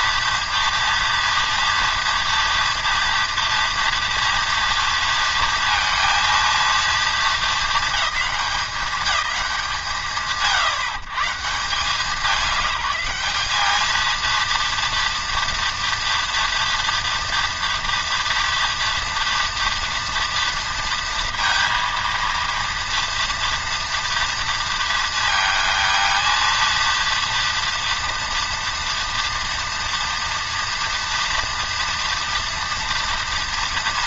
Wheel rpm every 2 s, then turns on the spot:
230, 230, 230, 230, 210, 100, 200, 230, 240, 230, 230, 230, 230, 220, 230, 230, 230.
none